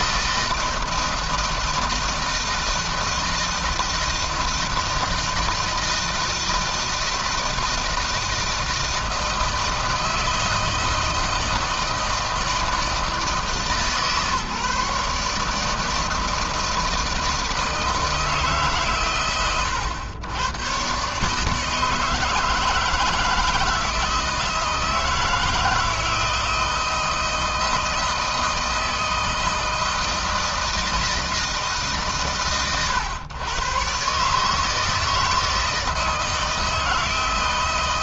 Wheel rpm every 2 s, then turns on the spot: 160, 160, 160, 160, 160, 160, 160, 150, 160, 130, 130, 160, 160, 160, 160, 160, 130, 160, 160.
none